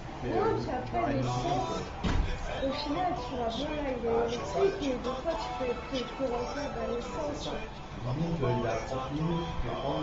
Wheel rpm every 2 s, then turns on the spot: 0, 0, 0, 0, 0.
none